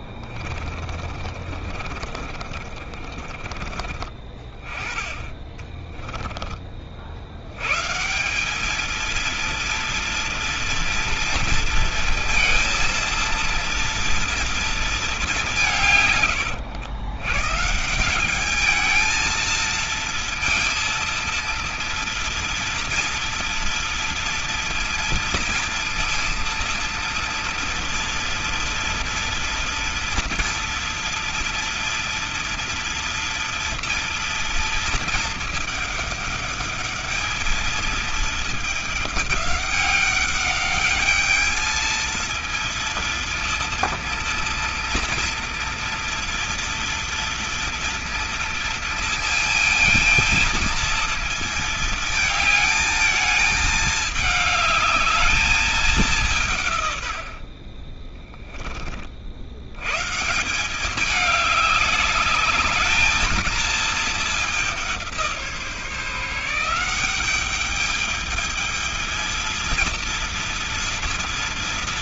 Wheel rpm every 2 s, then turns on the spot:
40, 40, 30, 40, 220, 230, 230, 220, 110, 220, 230, 230, 230, 230, 230, 230, 230, 230, 210, 210, 210, 230, 230, 230, 230, 230, 220, 210, 120, 30, 190, 220, 190, 180, 220, 230.
0-4